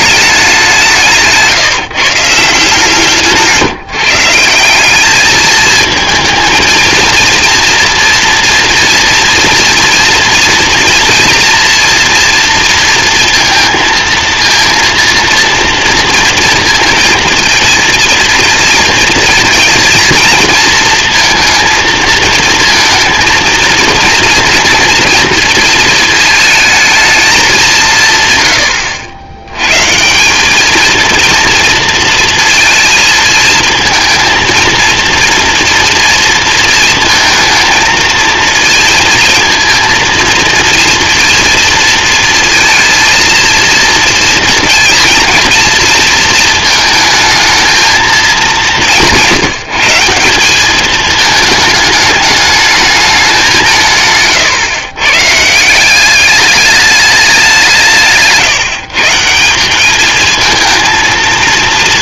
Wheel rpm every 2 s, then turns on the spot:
180, 160, 190, 230, 230, 230, 230, 230, 230, 230, 230, 230, 230, 220, 90, 220, 220, 230, 230, 230, 230, 230, 230, 220, 180, 210, 210, 120, 210, 160, 230.
none